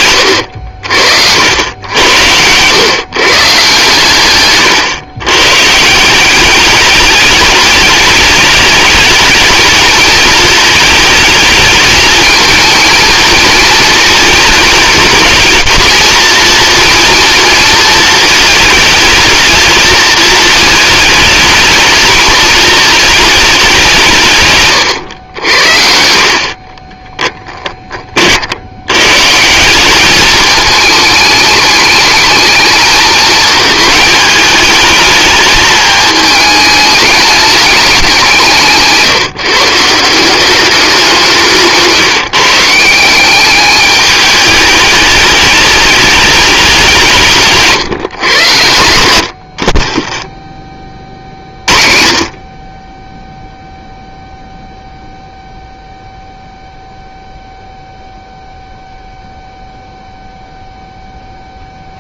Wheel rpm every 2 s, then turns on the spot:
80, 110, 110, 200, 210, 220, 220, 220, 230, 220, 220, 220, 130, 30, 90, 210, 220, 210, 210, 160, 190, 160, 210, 190, 100, 20, 20, 0, 0, 0, 0.
24-28